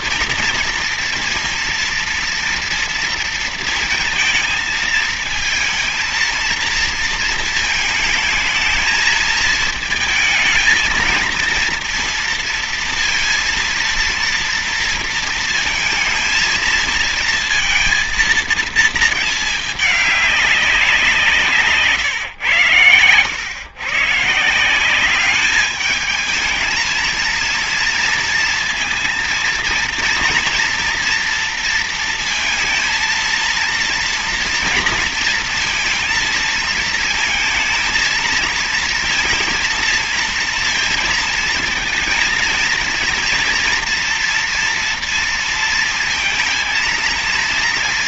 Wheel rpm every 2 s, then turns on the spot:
230, 230, 220, 230, 220, 220, 230, 230, 230, 230, 190, 110, 170, 220, 230, 230, 230, 230, 220, 230, 230, 230, 230, 230.
none